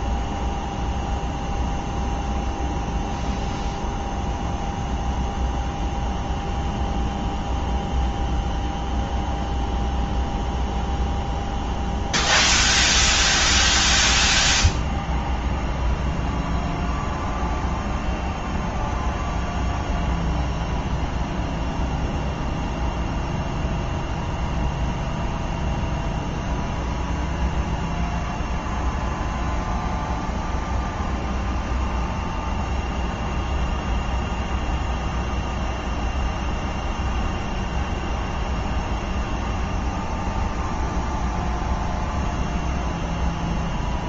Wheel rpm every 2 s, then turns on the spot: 0, 0, 0, 0, 0, 0, 0, 0, 0, 0, 0, 0, 0, 0, 0, 0, 0, 0, 0, 0, 0, 0.
none